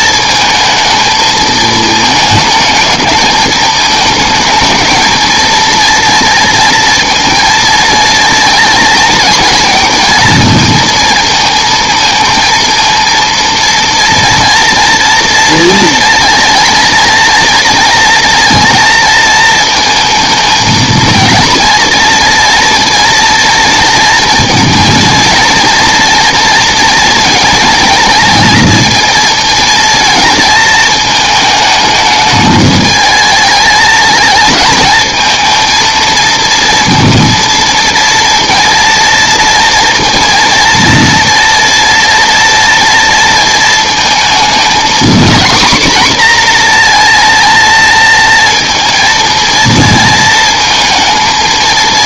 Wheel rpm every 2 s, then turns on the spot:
220, 220, 220, 230, 240, 230, 230, 230, 230, 230, 220, 230, 230, 230, 230, 230, 210, 220, 230, 230, 230, 230, 220, 250, 230, 220.
none